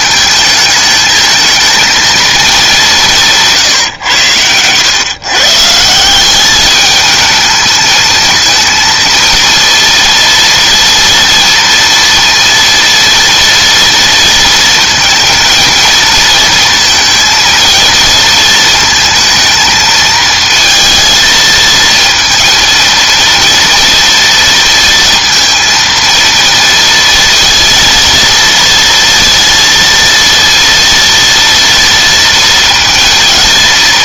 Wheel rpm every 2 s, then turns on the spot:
220, 190, 120, 210, 230, 230, 230, 230, 230, 230, 230, 230, 230, 230, 230, 230, 230.
none